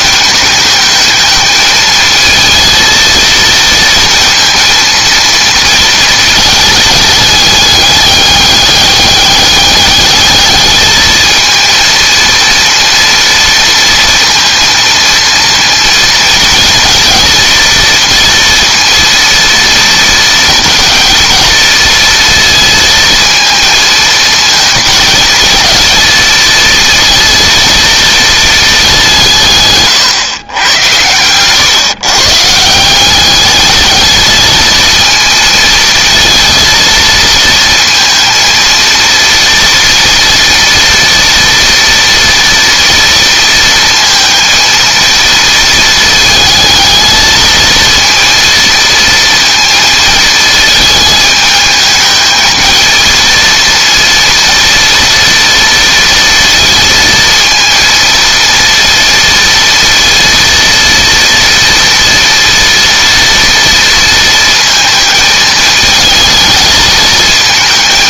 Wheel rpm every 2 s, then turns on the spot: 210, 220, 230, 210, 200, 210, 230, 230, 230, 230, 230, 230, 220, 230, 210, 110, 170, 220, 220, 230, 240, 230, 230, 220, 230, 220, 230, 230, 230, 230, 240, 240, 230, 220.
none